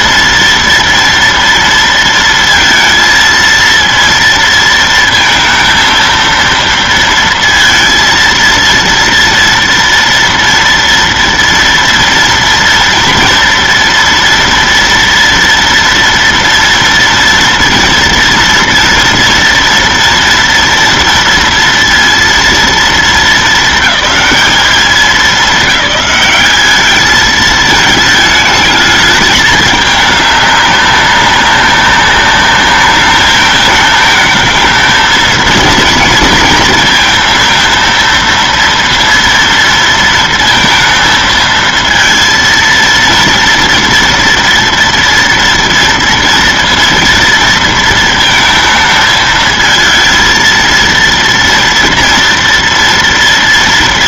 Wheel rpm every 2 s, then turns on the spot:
230, 230, 230, 230, 230, 230, 230, 230, 230, 230, 230, 230, 190, 200, 220, 200, 200, 220, 230, 230, 230, 230, 230, 230, 230, 230, 230.
none